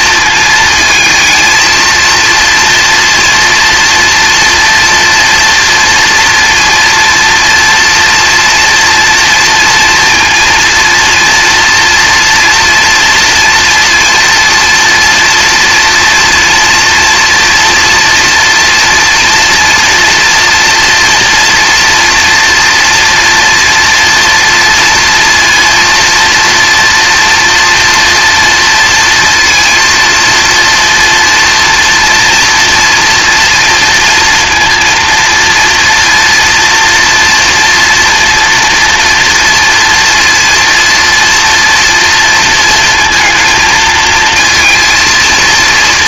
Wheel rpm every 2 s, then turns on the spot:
230, 230, 240, 230, 230, 230, 240, 230, 230, 230, 240, 230, 230, 240, 230, 230, 230, 230, 230, 230, 230, 230, 230.
none